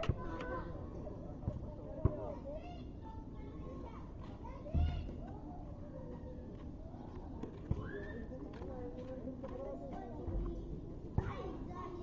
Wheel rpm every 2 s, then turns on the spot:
10, 0, 0, 0, 0, 0.
none